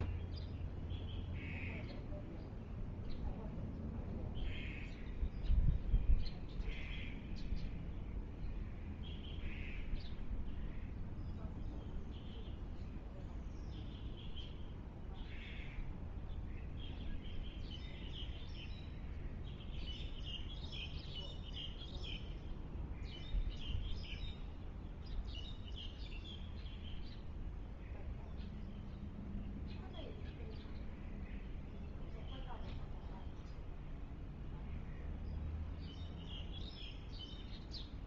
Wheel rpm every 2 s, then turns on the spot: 0, 0, 0, 0, 0, 0, 0, 0, 0, 0, 0, 0, 0, 0, 0, 0, 0, 0, 0.
none